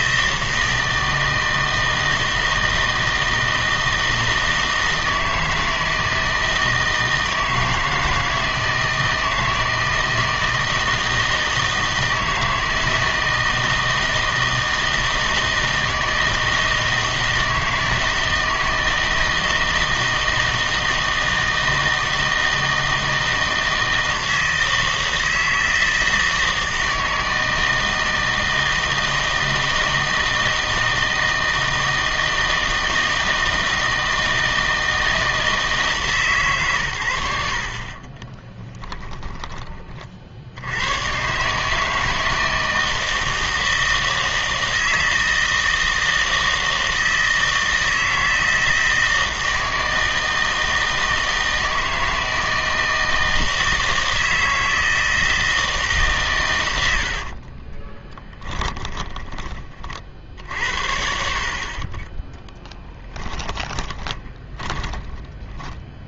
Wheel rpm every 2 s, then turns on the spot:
160, 160, 160, 160, 160, 160, 160, 160, 160, 160, 160, 160, 160, 160, 160, 160, 160, 160, 120, 10, 90, 160, 160, 160, 160, 160, 160, 160, 100, 20, 60, 10, 10.
38-40 58-60 64-66